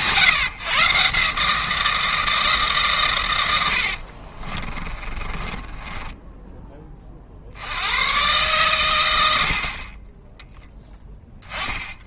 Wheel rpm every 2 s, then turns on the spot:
140, 140, 30, 10, 120, 10.
4-6